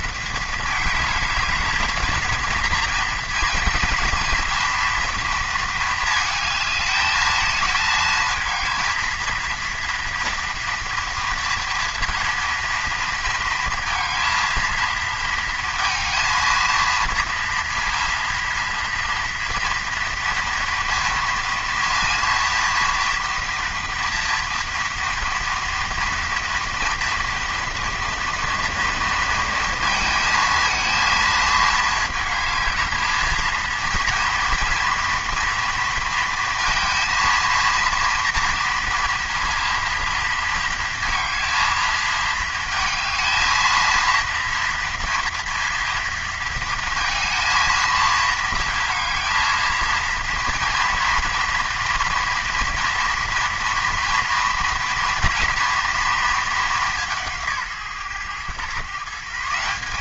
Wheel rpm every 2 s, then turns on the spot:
220, 230, 230, 220, 230, 230, 230, 230, 230, 230, 230, 230, 230, 230, 230, 220, 220, 230, 230, 230, 230, 220, 230, 230, 230, 230, 230, 230, 200, 130.
none